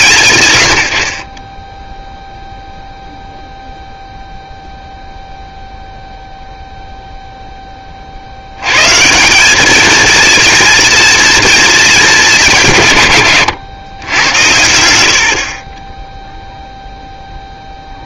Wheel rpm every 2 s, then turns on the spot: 100, 0, 0, 0, 110, 220, 170, 90, 0.
none